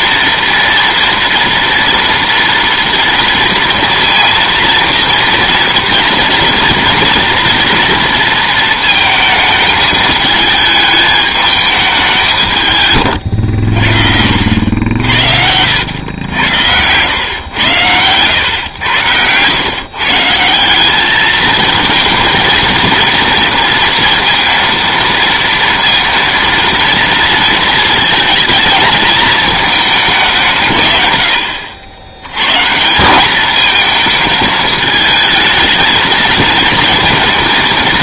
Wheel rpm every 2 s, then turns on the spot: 240, 230, 230, 230, 230, 210, 130, 70, 100, 100, 180, 230, 230, 230, 220, 150, 150, 220, 230.
none